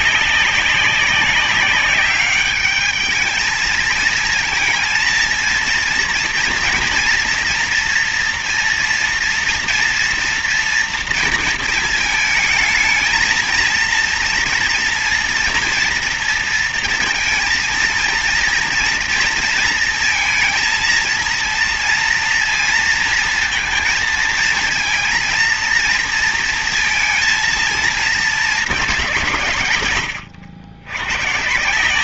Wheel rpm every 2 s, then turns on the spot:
190, 200, 220, 230, 230, 230, 220, 230, 230, 230, 230, 230, 230, 230, 210, 100.
none